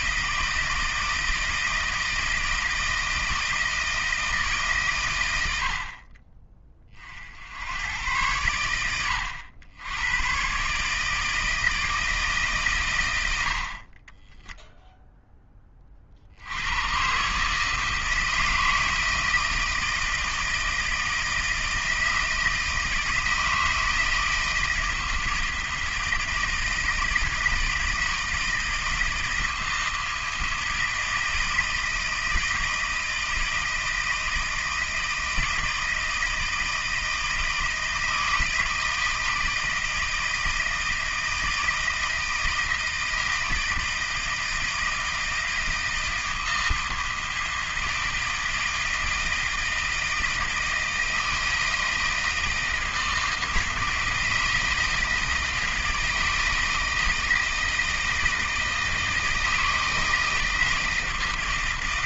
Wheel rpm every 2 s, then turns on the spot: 160, 160, 140, 40, 100, 150, 130, 0, 100, 160, 160, 160, 160, 170, 160, 160, 160, 160, 160, 160, 160, 160, 160, 160, 160, 160, 160, 160, 160, 160, 160.
none